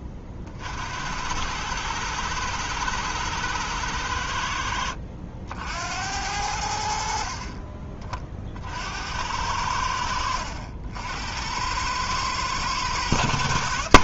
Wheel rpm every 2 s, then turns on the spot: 60, 120, 70, 80, 50, 70, 110.
none